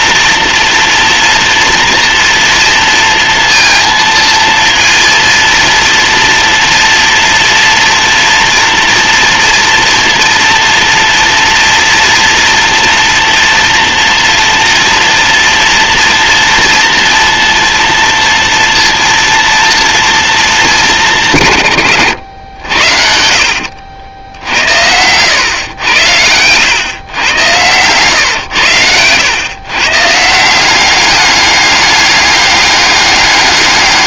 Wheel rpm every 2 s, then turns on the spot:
230, 230, 230, 240, 230, 230, 240, 230, 230, 230, 170, 60, 90, 120, 100, 200, 200.
22-24